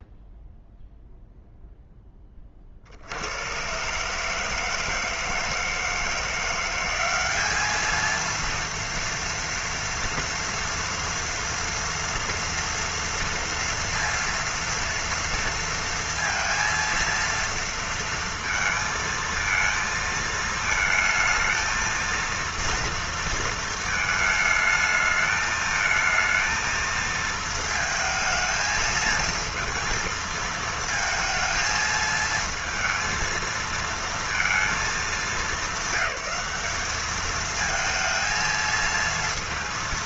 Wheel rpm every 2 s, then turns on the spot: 0, 20, 150, 170, 230, 230, 230, 230, 230, 230, 230, 230, 220, 220, 220, 220, 220, 230, 200, 230.
none